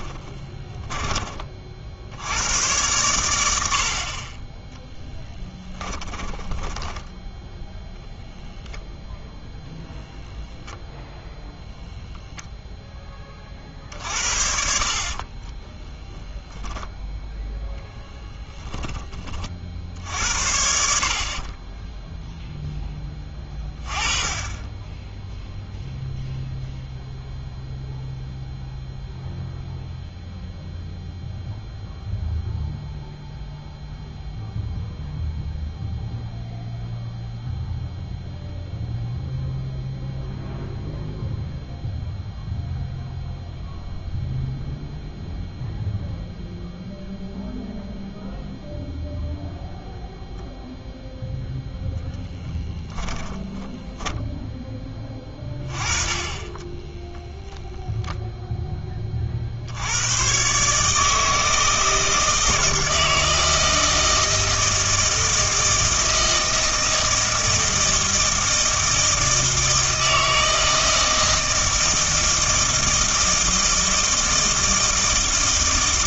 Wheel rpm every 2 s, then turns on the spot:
20, 110, 10, 20, 0, 0, 0, 50, 0, 20, 70, 10, 10, 0, 0, 0, 0, 0, 0, 0, 0, 0, 0, 0, 0, 0, 10, 10, 10, 10, 140, 160, 160, 160, 160, 160, 160, 160.
0-2 6-8 52-54 56-58